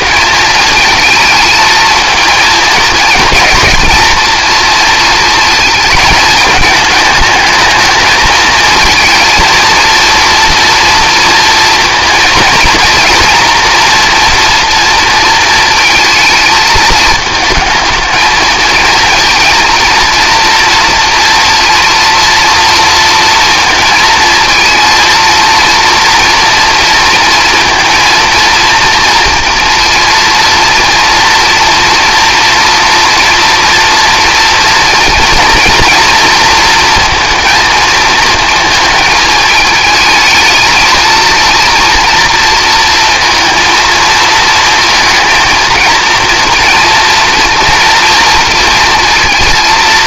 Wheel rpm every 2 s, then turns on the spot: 230, 230, 230, 220, 220, 230, 230, 240, 220, 220, 230, 230, 230, 230, 230, 230, 230, 230, 230, 230, 220, 230, 230, 230, 240.
none